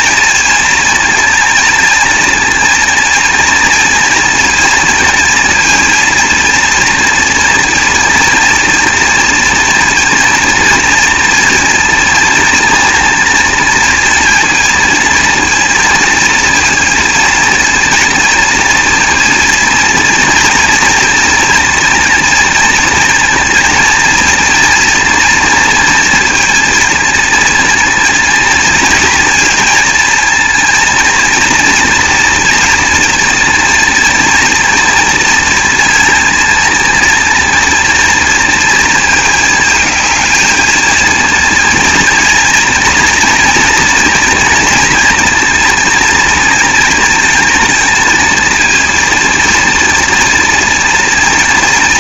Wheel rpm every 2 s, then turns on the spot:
230, 230, 230, 230, 230, 230, 230, 230, 230, 230, 230, 240, 230, 230, 230, 230, 230, 230, 220, 230, 220, 230, 230, 230, 230, 230.
none